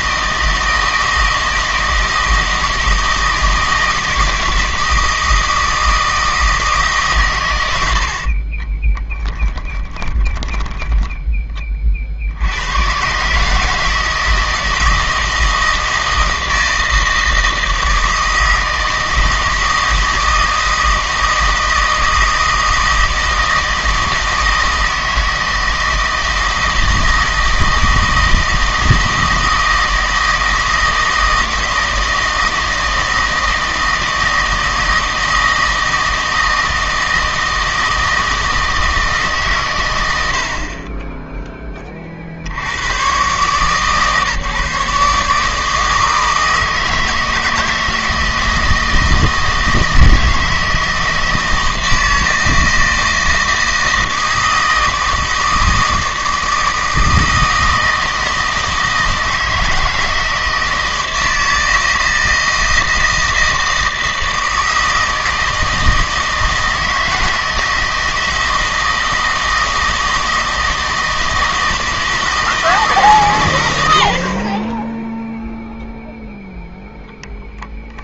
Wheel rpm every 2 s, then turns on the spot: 160, 160, 160, 150, 20, 10, 100, 160, 160, 160, 160, 160, 160, 160, 160, 160, 160, 160, 160, 160, 40, 100, 150, 160, 160, 160, 160, 160, 160, 160, 160, 160, 160, 160, 160, 160, 160, 20, 0.
8-12